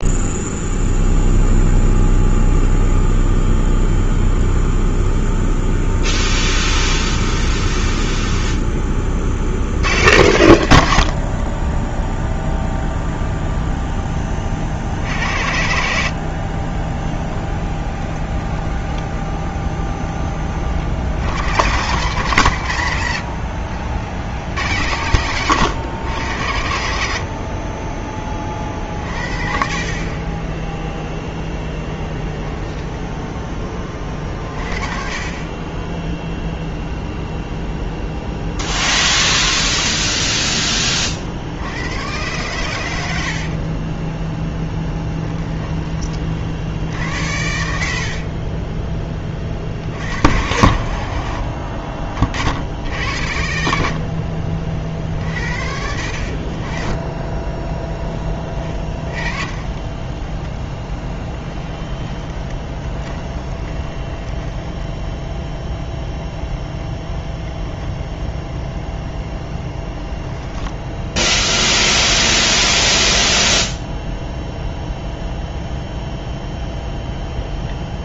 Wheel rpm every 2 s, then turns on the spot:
0, 0, 0, 0, 30, 70, 0, 70, 20, 20, 70, 100, 90, 70, 40, 0, 0, 30, 0, 80, 30, 80, 10, 70, 20, 50, 70, 50, 20, 20, 10, 10, 10, 0, 0, 10, 0, 0, 0.
16-20 44-46 52-54 58-66 70-72